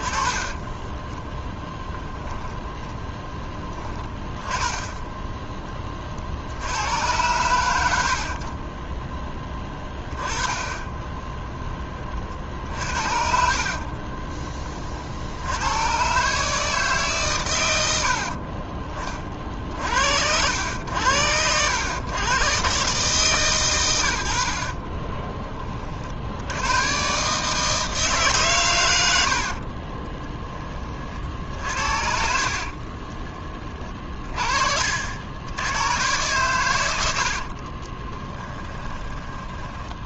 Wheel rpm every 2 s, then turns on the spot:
10, 10, 20, 90, 20, 20, 50, 50, 150, 30, 90, 140, 30, 120, 100, 40, 30, 60, 90, 20.
4-6 32-34 36-40